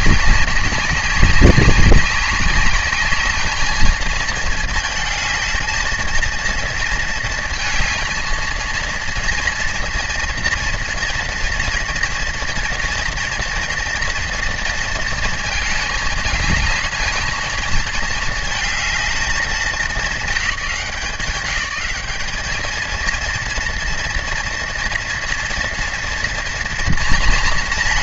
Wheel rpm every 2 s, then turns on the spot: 190, 200, 220, 230, 230, 230, 230, 230, 210, 220, 210, 220, 230, 230.
none